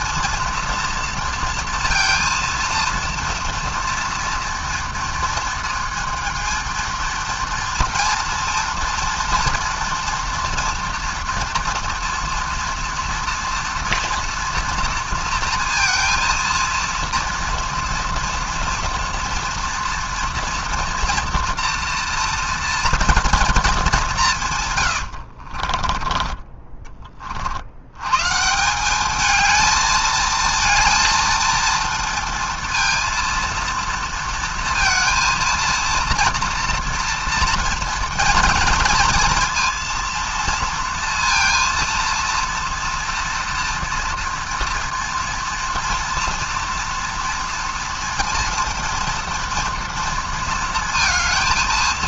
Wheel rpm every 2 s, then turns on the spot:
240, 230, 230, 230, 240, 240, 240, 240, 230, 230, 230, 230, 140, 10, 160, 220, 230, 230, 230, 230, 230, 230, 230, 240, 230, 230.
none